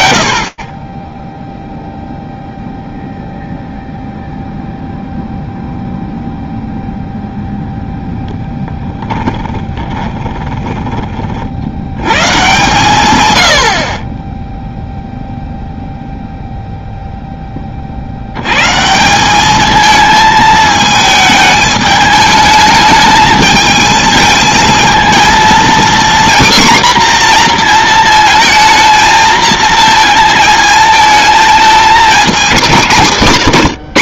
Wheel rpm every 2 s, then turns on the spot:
0, 0, 0, 0, 30, 110, 30, 0, 40, 220, 210, 220, 240, 230, 230, 220, 210.
8-10